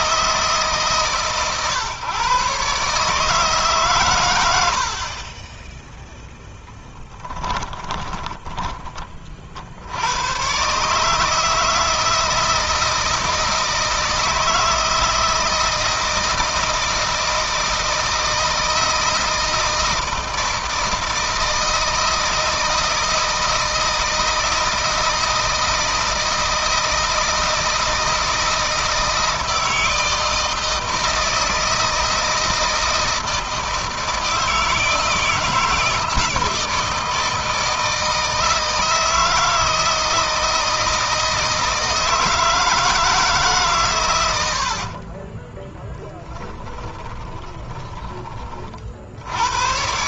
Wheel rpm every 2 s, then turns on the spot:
140, 140, 60, 10, 20, 140, 160, 160, 160, 160, 160, 160, 160, 160, 160, 160, 160, 160, 160, 160, 160, 160, 60, 20, 50.
44-48